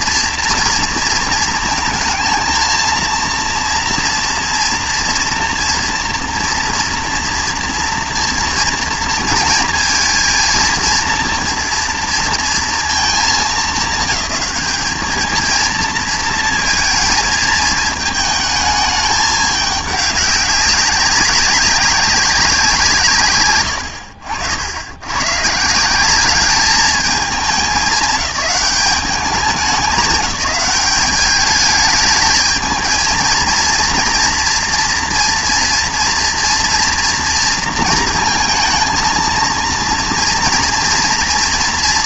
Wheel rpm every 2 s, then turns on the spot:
230, 220, 230, 230, 240, 230, 230, 200, 220, 210, 190, 180, 60, 200, 210, 200, 220, 230, 240, 230, 230.
none